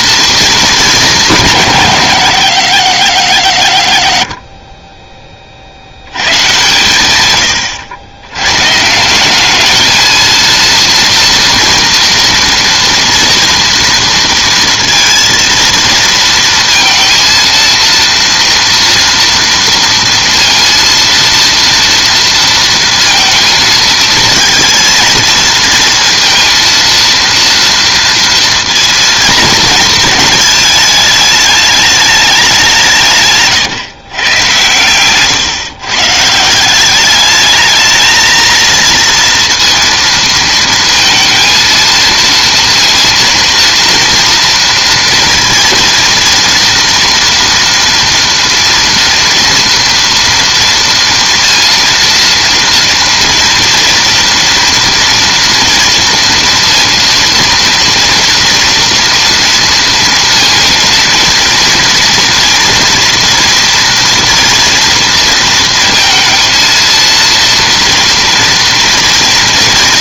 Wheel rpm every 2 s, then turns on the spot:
220, 120, 30, 110, 140, 230, 230, 230, 230, 230, 230, 230, 220, 230, 230, 220, 190, 120, 170, 230, 230, 230, 230, 230, 230, 230, 230, 230, 230, 230, 230, 240, 230, 230, 230.
none